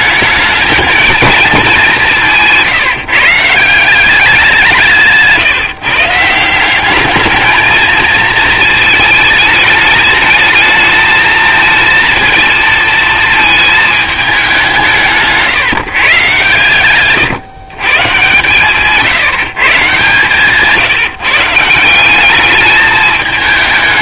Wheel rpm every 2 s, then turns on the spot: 210, 150, 180, 190, 220, 220, 230, 180, 130, 140, 140, 210.
none